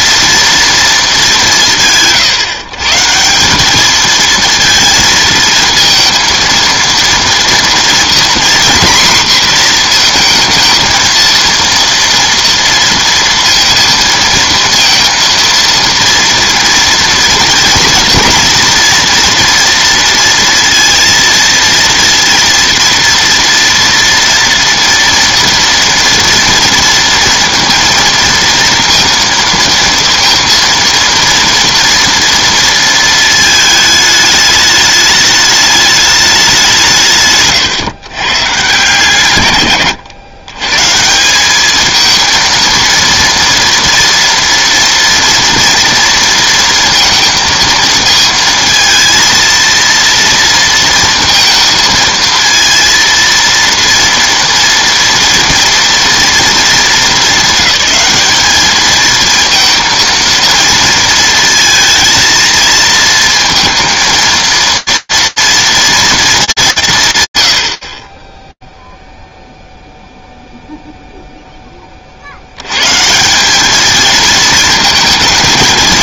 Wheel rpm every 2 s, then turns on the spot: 230, 140, 230, 230, 240, 230, 230, 230, 230, 230, 230, 230, 230, 230, 230, 230, 230, 210, 200, 140, 120, 230, 240, 230, 230, 230, 230, 230, 230, 210, 230, 220, 230, 180, 0, 0, 100, 220.
none